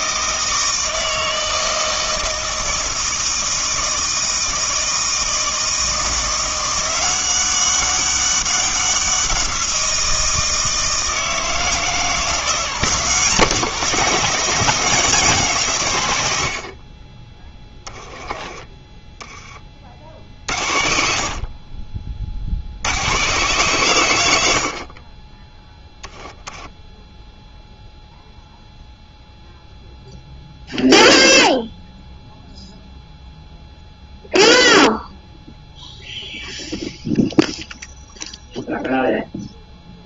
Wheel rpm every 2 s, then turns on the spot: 160, 160, 160, 180, 190, 160, 180, 190, 50, 20, 70, 110, 60, 10, 0, 0, 0, 0, 0, 0.
18-20